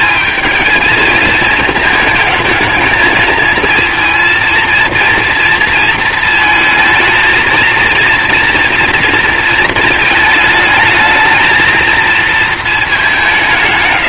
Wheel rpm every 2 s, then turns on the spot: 220, 220, 230, 220, 230, 220, 200.
none